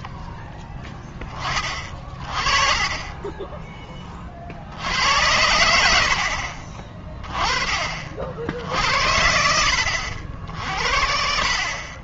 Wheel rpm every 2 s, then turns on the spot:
0, 30, 60, 40, 80, 50.
none